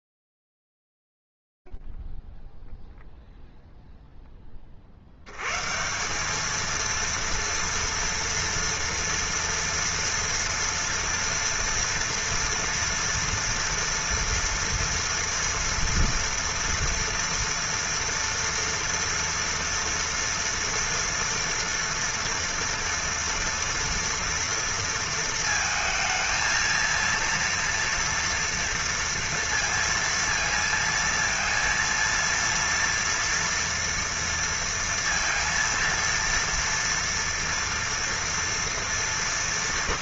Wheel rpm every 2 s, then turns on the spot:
0, 0, 0, 140, 240, 230, 230, 230, 240, 230, 230, 240, 240, 220, 230, 230, 230, 230, 230, 230.
none